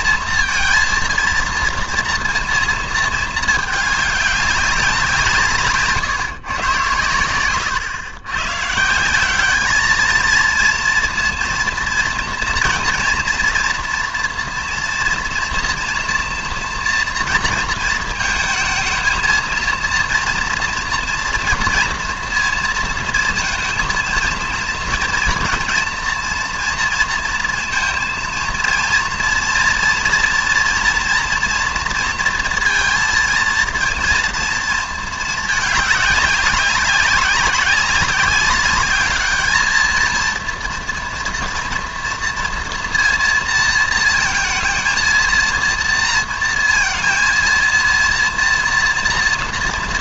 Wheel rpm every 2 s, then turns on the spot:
230, 230, 190, 120, 140, 230, 240, 230, 230, 220, 230, 230, 230, 230, 230, 230, 230, 230, 200, 200, 230, 230, 220, 230, 240.
none